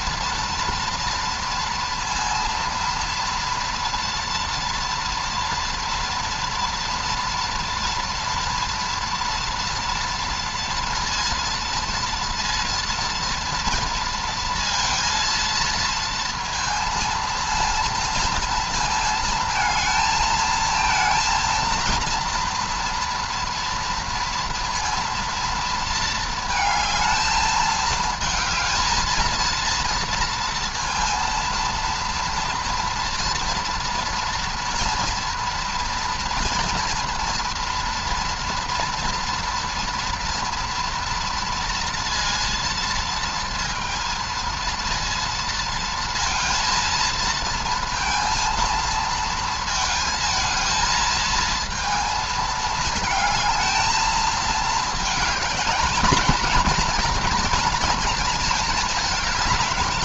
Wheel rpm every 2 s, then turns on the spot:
230, 230, 240, 240, 240, 230, 230, 230, 230, 220, 230, 230, 230, 220, 220, 230, 230, 230, 230, 230, 230, 230, 230, 230, 230, 220, 220, 220, 230, 220.
none